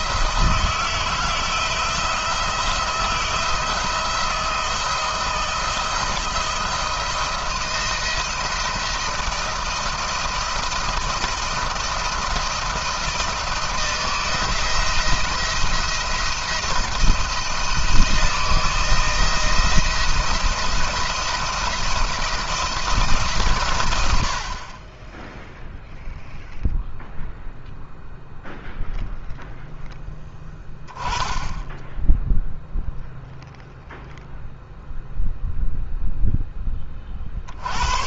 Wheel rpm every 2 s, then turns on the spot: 160, 170, 170, 170, 170, 170, 170, 170, 170, 170, 170, 160, 40, 0, 0, 10, 0, 0, 10.
none